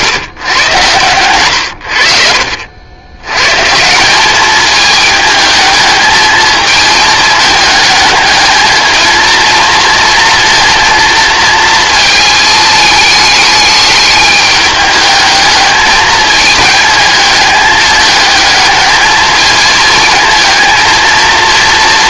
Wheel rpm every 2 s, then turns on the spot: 120, 70, 220, 220, 220, 230, 220, 210, 220, 220, 230.
none